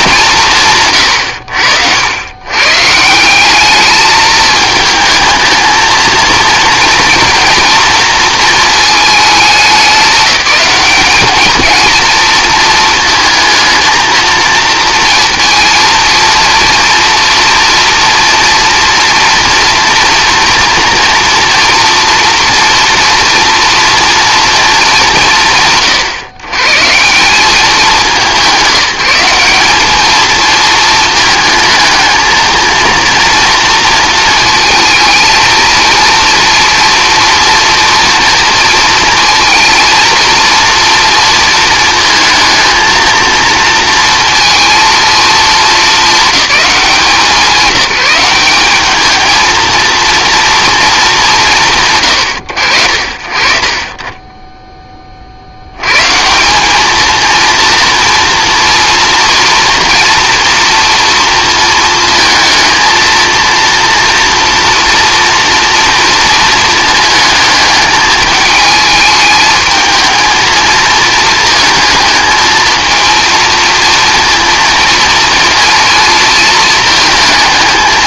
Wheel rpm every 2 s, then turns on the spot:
150, 130, 220, 230, 230, 190, 220, 230, 230, 240, 230, 230, 220, 130, 190, 220, 230, 230, 230, 230, 230, 230, 230, 210, 200, 230, 90, 20, 190, 230, 230, 220, 230, 220, 210, 230, 230, 230, 230.
none